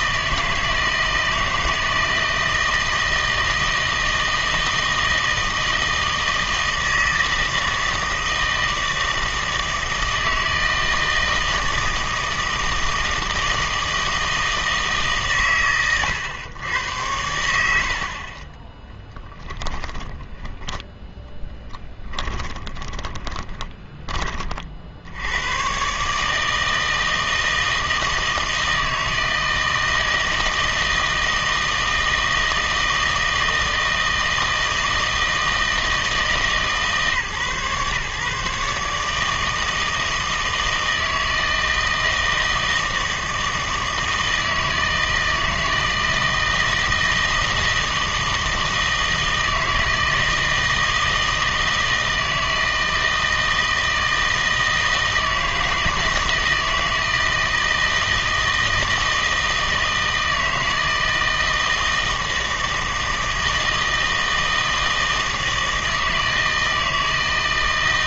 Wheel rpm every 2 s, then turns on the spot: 160, 160, 160, 160, 160, 160, 160, 160, 100, 20, 10, 20, 50, 160, 160, 160, 160, 160, 150, 140, 160, 160, 160, 160, 160, 160, 160, 160, 160, 160, 160, 160, 160, 160.
18-24